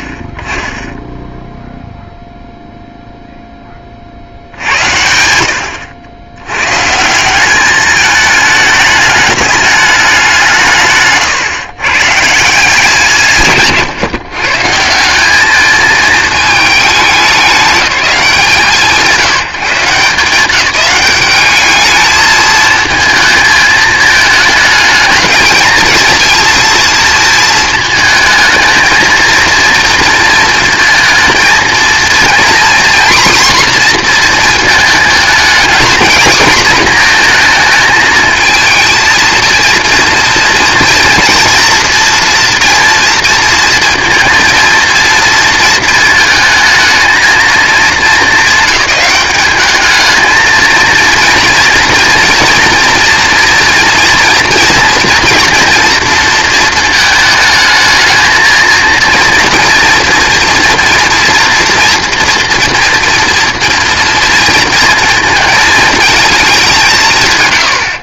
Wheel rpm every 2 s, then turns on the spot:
20, 0, 80, 110, 220, 170, 150, 140, 220, 180, 180, 220, 220, 230, 220, 230, 240, 220, 230, 230, 230, 230, 230, 220, 210, 220, 230, 230, 220, 220, 230, 230, 230, 210.
none